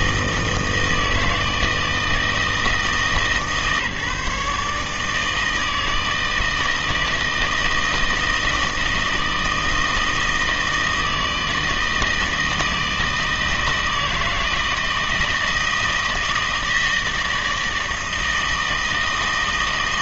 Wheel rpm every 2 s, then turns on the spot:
160, 160, 150, 160, 160, 160, 160, 160, 160, 160.
none